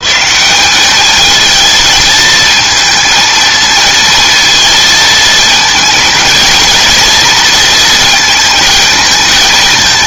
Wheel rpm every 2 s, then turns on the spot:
210, 220, 230, 230, 220.
none